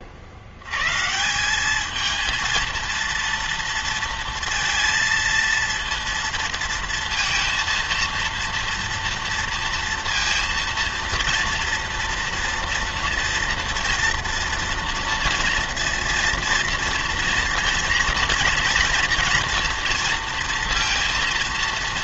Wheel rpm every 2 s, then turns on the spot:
90, 230, 230, 230, 230, 230, 240, 230, 230, 230, 230.
none